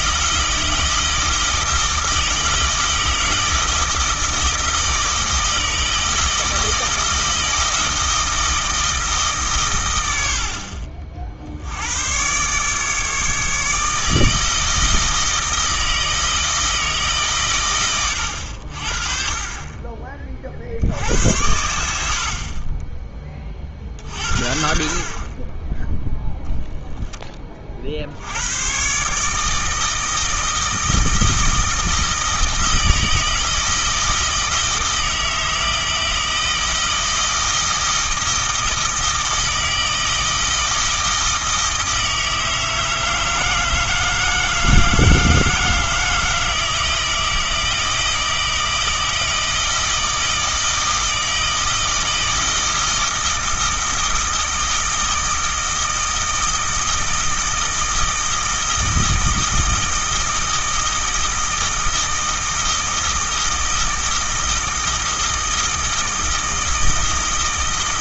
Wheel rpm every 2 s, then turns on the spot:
160, 160, 160, 160, 160, 50, 150, 160, 160, 60, 60, 20, 50, 0, 120, 160, 160, 160, 160, 160, 160, 160, 160, 160, 160, 160, 160, 160, 160, 160, 160, 160, 160, 160.
22-24